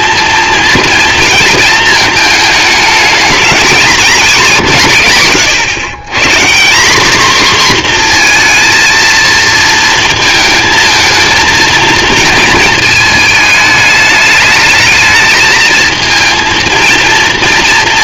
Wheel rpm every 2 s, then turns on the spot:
230, 220, 210, 160, 240, 220, 220, 210, 230.
4-6